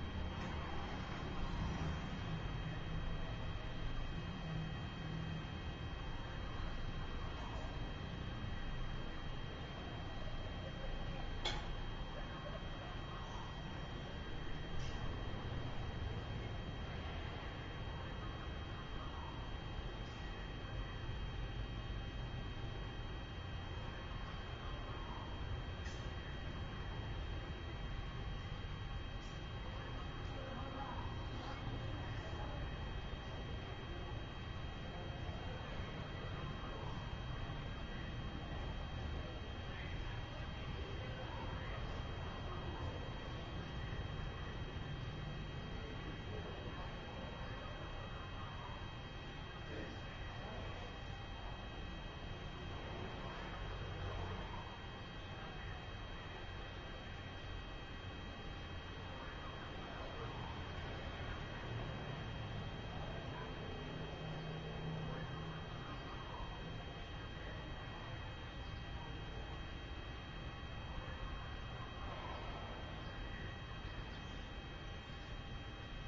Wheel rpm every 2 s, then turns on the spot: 0, 0, 0, 0, 0, 0, 0, 0, 0, 0, 0, 0, 0, 0, 0, 0, 0, 0, 0, 0, 0, 0, 0, 0, 0, 0, 0, 0, 0, 0, 0, 0, 0, 0, 0, 0, 0, 0.
none